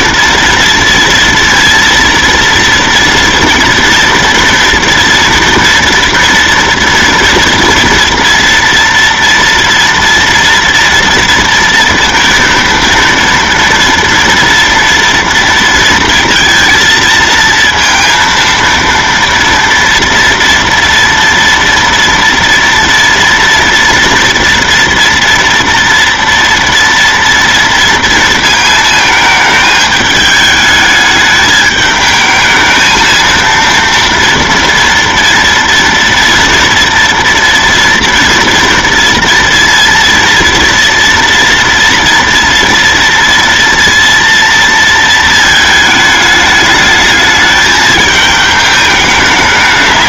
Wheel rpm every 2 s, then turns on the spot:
230, 230, 230, 230, 230, 230, 230, 230, 230, 230, 230, 240, 230, 230, 230, 220, 220, 230, 240, 230, 230, 230, 230, 210, 210.
none